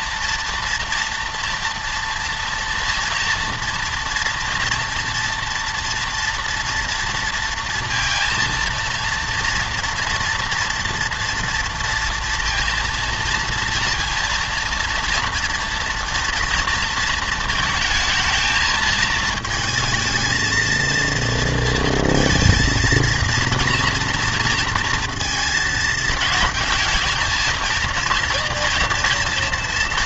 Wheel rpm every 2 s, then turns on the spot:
230, 230, 230, 240, 230, 230, 230, 230, 230, 220, 230, 230, 230, 220, 230.
none